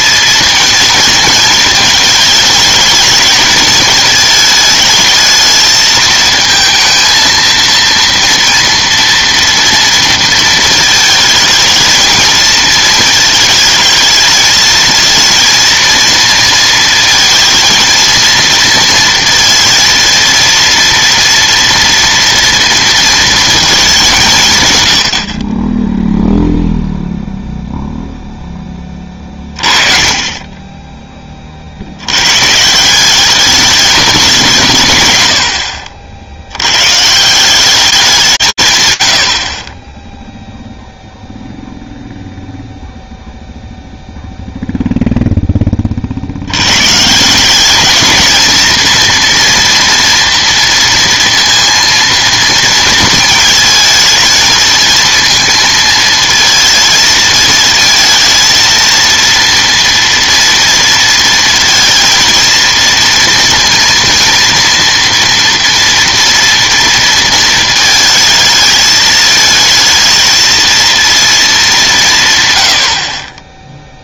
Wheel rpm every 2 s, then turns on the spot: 230, 220, 220, 220, 230, 230, 220, 220, 230, 230, 230, 230, 130, 0, 10, 10, 160, 160, 100, 130, 0, 0, 0, 100, 220, 230, 230, 230, 220, 220, 230, 230, 230, 230, 220, 220, 90.
none